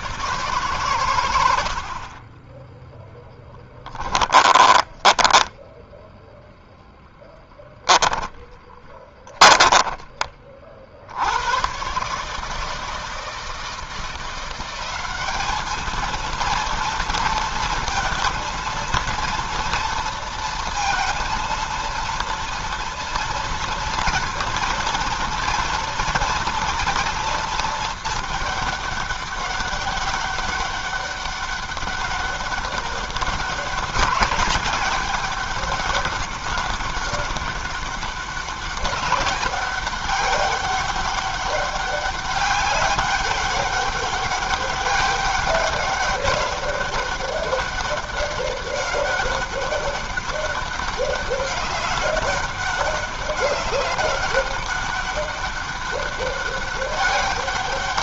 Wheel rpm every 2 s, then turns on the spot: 40, 10, 0, 10, 20, 110, 160, 200, 230, 230, 230, 230, 230, 230, 200, 200, 200, 200, 200, 200, 200, 200, 200, 200, 200, 200, 200, 200, 200.
2-4 8-10